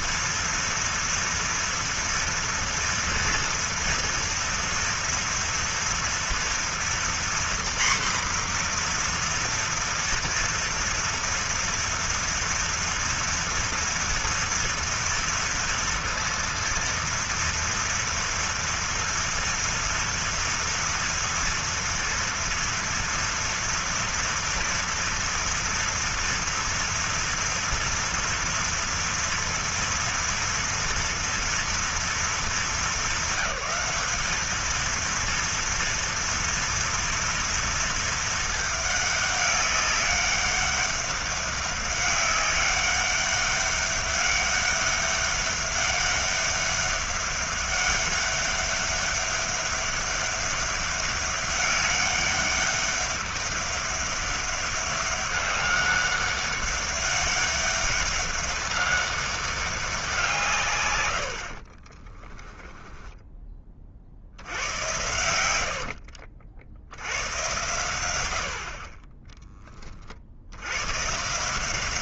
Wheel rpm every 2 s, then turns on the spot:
230, 230, 230, 240, 240, 230, 230, 230, 230, 230, 230, 230, 230, 230, 230, 230, 220, 220, 230, 210, 200, 200, 200, 200, 200, 200, 200, 200, 200, 200, 110, 10, 100, 80, 30, 130.
62-64